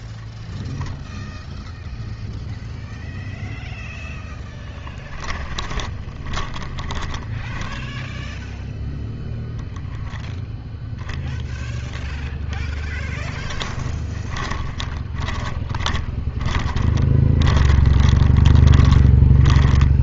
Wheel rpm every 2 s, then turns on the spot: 0, 0, 10, 10, 0, 0, 10, 20, 20, 20.
6-8 12-20